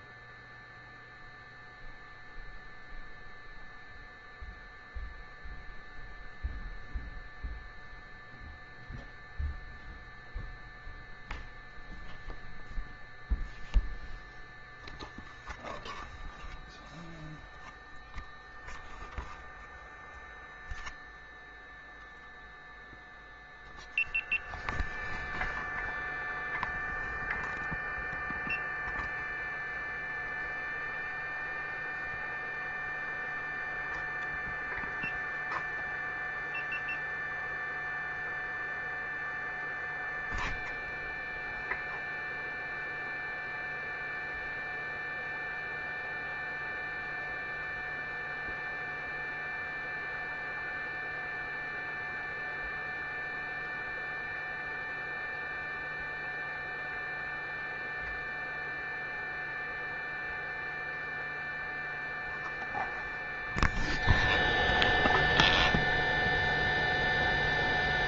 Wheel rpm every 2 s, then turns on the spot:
0, 0, 0, 0, 0, 0, 0, 0, 0, 0, 0, 0, 0, 0, 0, 0, 0, 0, 0, 0, 0, 0, 0, 0, 0, 0, 0, 0, 0, 0, 0, 0, 0, 0.
none